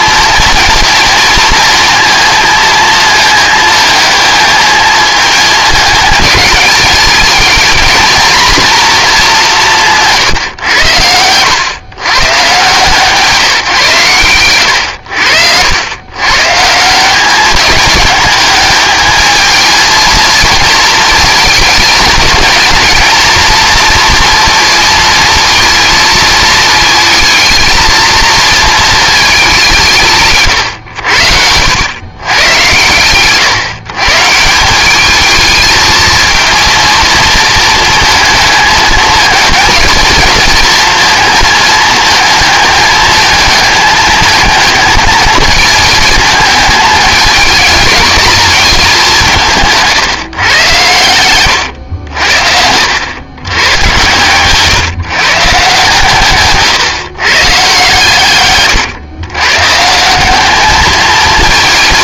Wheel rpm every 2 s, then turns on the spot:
230, 220, 220, 220, 230, 110, 150, 100, 160, 210, 230, 230, 230, 220, 220, 90, 110, 190, 230, 220, 220, 220, 220, 220, 200, 120, 80, 150, 140, 130, 210.
none